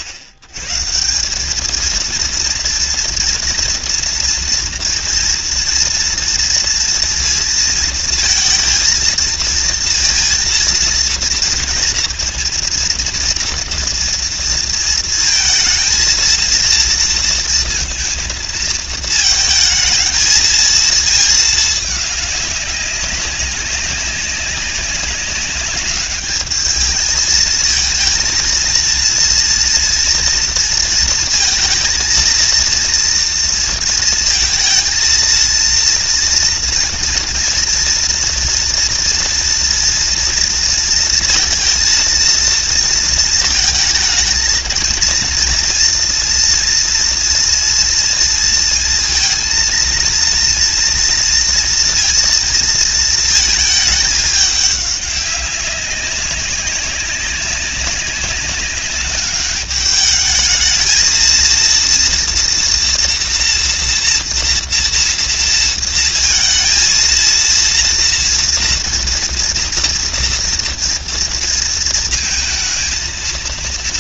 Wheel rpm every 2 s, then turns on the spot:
100, 230, 230, 230, 230, 230, 230, 230, 230, 220, 230, 200, 200, 210, 230, 230, 230, 230, 230, 230, 230, 230, 230, 230, 230, 230, 230, 200, 200, 200, 220, 230, 230, 220, 230, 240, 230.
none